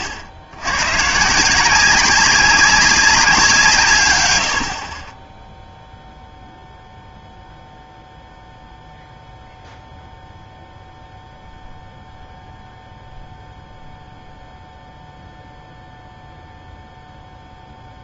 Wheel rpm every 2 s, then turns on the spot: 110, 190, 70, 0, 0, 0, 0, 0, 0.
none